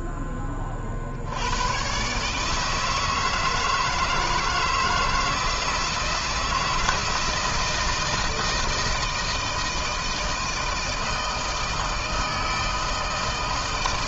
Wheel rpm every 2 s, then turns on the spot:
60, 160, 160, 160, 160, 160, 160.
none